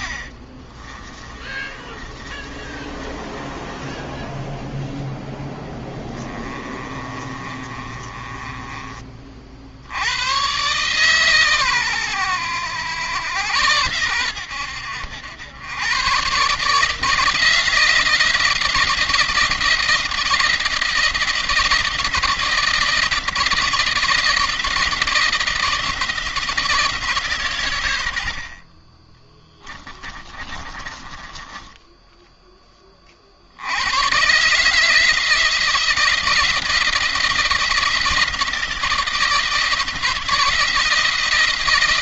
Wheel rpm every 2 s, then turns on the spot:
30, 30, 0, 20, 30, 130, 110, 90, 150, 170, 170, 160, 160, 160, 40, 20, 20, 150, 170, 170, 170.
0-4 6-8 30-32